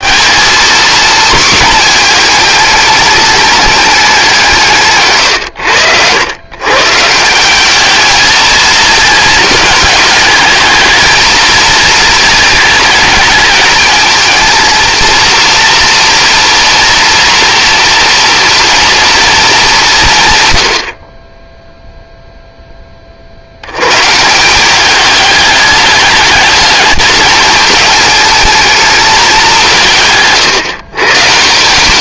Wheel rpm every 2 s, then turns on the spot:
230, 210, 150, 140, 220, 220, 210, 230, 230, 230, 80, 10, 190, 220, 220, 130.
none